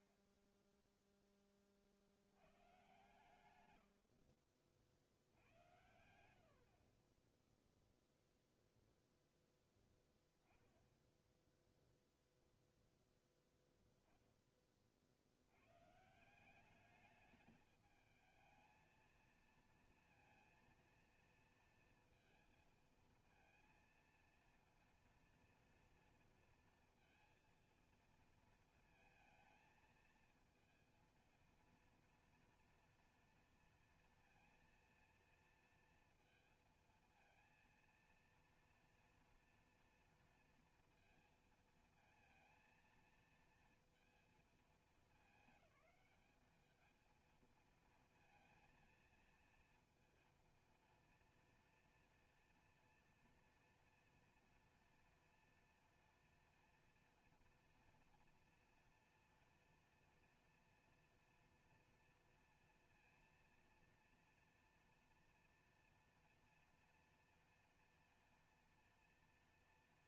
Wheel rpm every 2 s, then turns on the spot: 90, 40, 50, 0, 10, 0, 20, 190, 230, 230, 230, 230, 230, 230, 230, 230, 230, 230, 230, 230, 230, 220, 210, 230, 230, 230, 230, 230, 230, 230, 240, 230, 230, 230, 230.
none